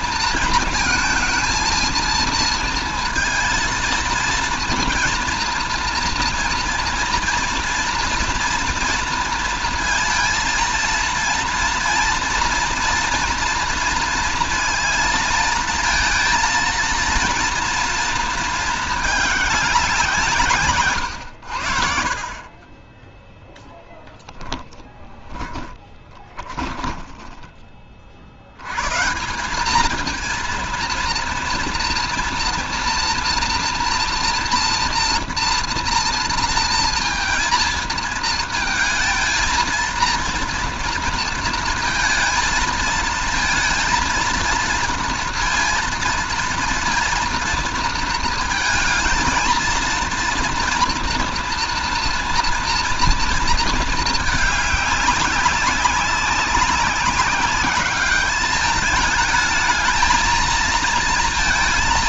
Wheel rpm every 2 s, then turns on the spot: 220, 230, 230, 230, 230, 230, 230, 230, 230, 220, 140, 30, 20, 20, 110, 230, 230, 230, 230, 220, 230, 220, 230, 230, 230, 230, 240, 210, 200, 210, 220.
24-28